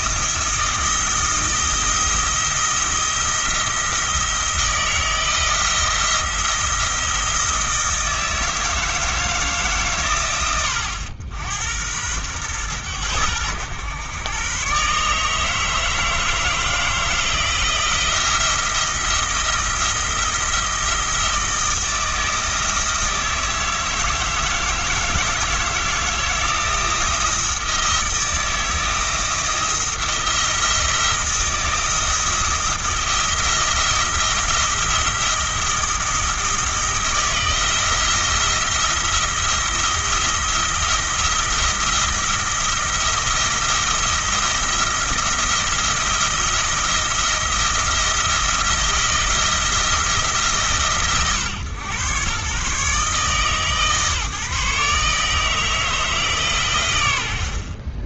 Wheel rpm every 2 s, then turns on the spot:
170, 170, 170, 170, 160, 90, 110, 140, 160, 170, 160, 160, 160, 160, 160, 170, 170, 170, 170, 160, 170, 170, 170, 170, 170, 140, 130, 140, 120.
none